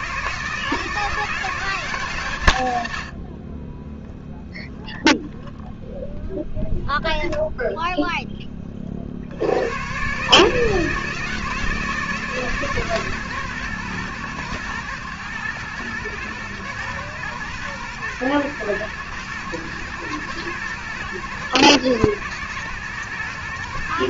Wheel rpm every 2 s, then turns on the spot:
160, 120, 0, 0, 10, 150, 150, 120, 110, 110, 120, 110.
none